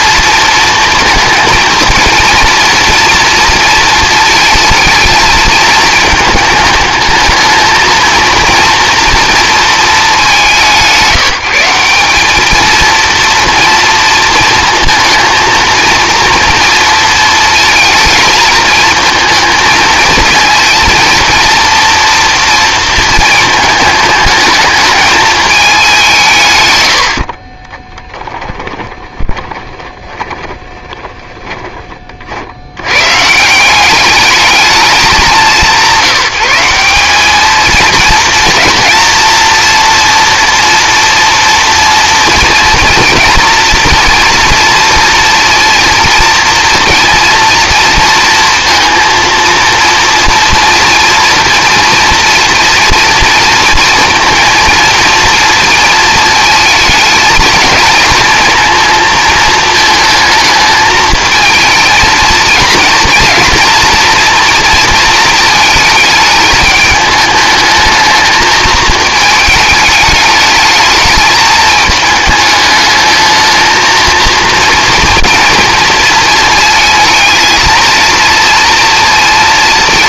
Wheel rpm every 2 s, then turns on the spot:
230, 230, 230, 210, 230, 180, 210, 230, 230, 220, 230, 230, 220, 120, 10, 20, 80, 220, 180, 240, 230, 230, 230, 240, 230, 240, 230, 230, 220, 230, 220, 230, 240, 210, 220, 210, 210, 230, 230, 230.
28-32